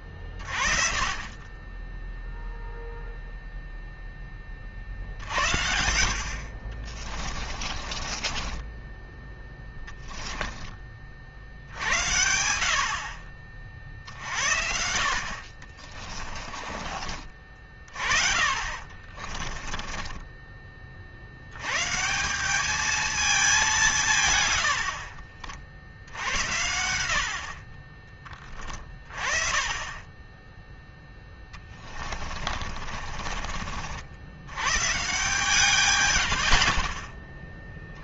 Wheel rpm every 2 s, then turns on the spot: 30, 0, 50, 40, 10, 40, 60, 60, 40, 30, 50, 210, 70, 90, 20, 10, 40, 130, 30.
6-10 14-16 18-20 24-26 30-34 36-38